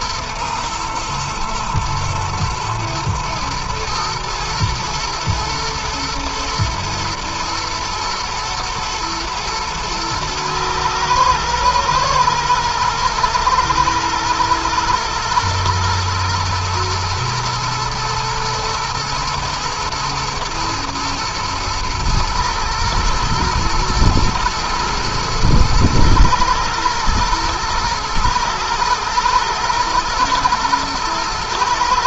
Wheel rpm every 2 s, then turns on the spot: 110, 120, 120, 120, 110, 110, 110, 110, 120, 110, 110, 110, 120, 110, 110, 110.
none